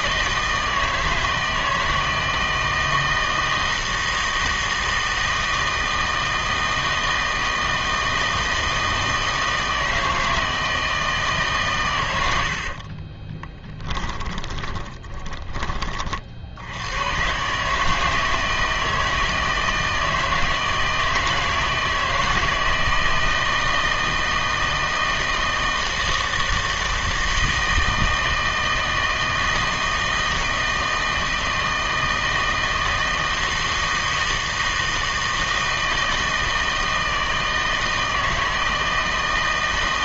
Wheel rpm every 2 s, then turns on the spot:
160, 160, 160, 160, 160, 160, 60, 20, 80, 160, 160, 160, 160, 160, 160, 160, 160, 160, 160, 160.
12-16